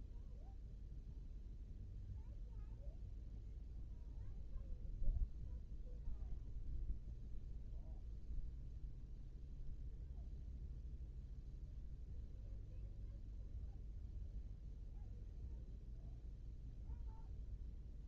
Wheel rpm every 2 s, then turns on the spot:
0, 0, 0, 0, 0, 0, 0, 0, 0.
none